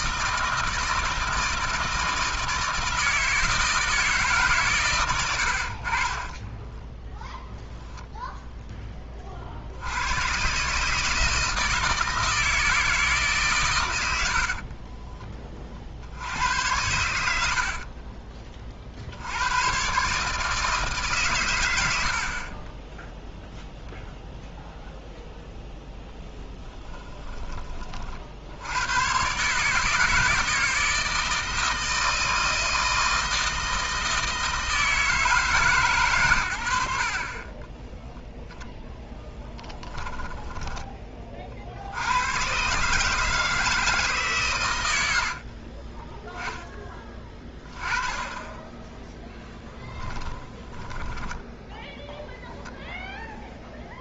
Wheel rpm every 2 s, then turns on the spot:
160, 160, 140, 10, 10, 140, 160, 40, 80, 40, 160, 20, 0, 20, 80, 160, 160, 160, 80, 10, 10, 130, 120, 10, 20, 20, 0.
6-8 14-16 26-28 48-52